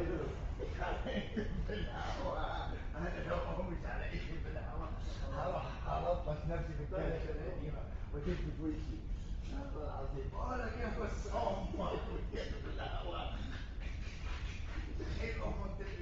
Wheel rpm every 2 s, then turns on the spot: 0, 0, 0, 0, 0, 0, 0, 0.
none